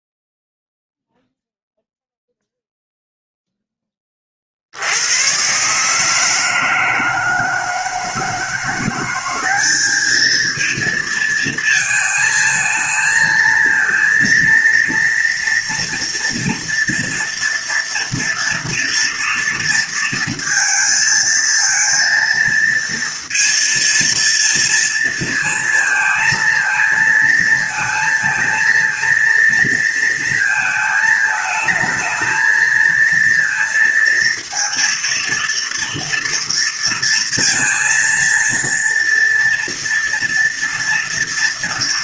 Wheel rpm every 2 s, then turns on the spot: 0, 0, 50, 160, 170, 220, 220, 230, 230, 230, 230, 230, 230, 230, 230, 230, 220, 230, 230, 230, 230.
none